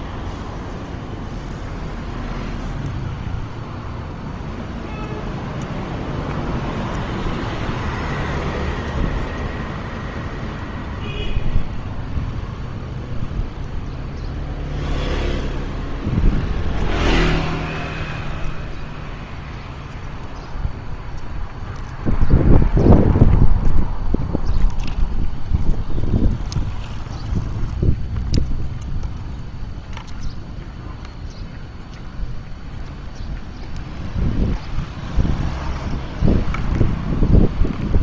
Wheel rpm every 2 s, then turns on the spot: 0, 0, 0, 0, 0, 0, 0, 0, 0, 0, 0, 0, 0, 0, 0, 0, 0, 0, 0.
none